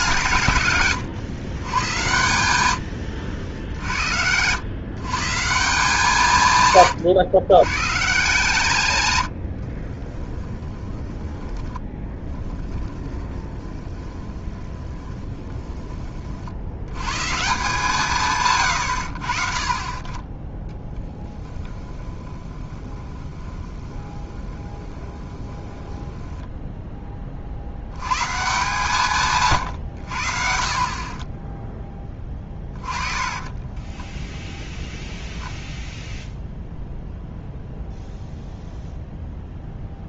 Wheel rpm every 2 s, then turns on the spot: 120, 90, 120, 150, 150, 20, 10, 20, 80, 100, 10, 20, 20, 10, 140, 50, 20, 0, 0, 0.
10-16 20-26 32-34